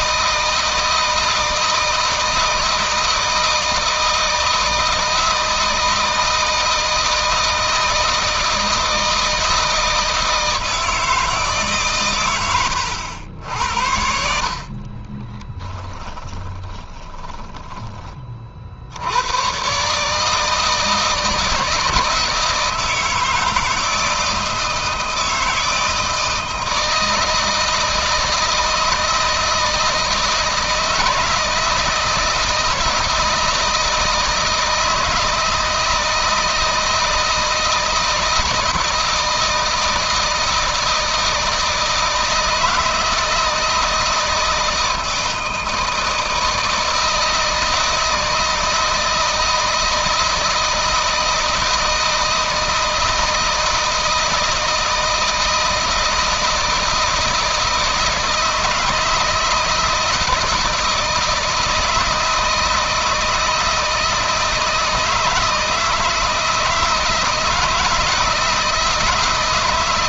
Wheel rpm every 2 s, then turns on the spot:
160, 160, 160, 160, 160, 160, 90, 40, 30, 60, 160, 160, 160, 160, 160, 160, 160, 160, 160, 160, 160, 160, 160, 160, 160, 160, 160, 160, 160, 160, 160, 160, 160, 160, 160.
14-18